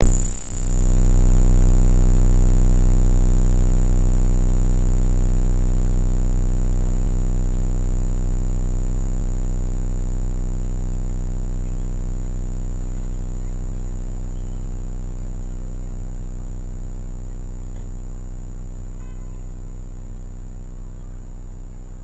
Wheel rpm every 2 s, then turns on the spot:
0, 0, 0, 0, 0, 0, 0, 0, 0, 0, 0.
none